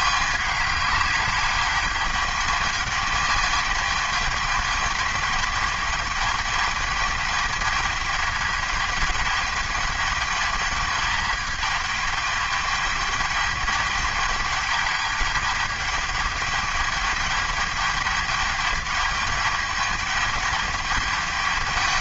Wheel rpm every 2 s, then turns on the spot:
200, 210, 210, 220, 210, 210, 210, 210, 210, 210, 210.
none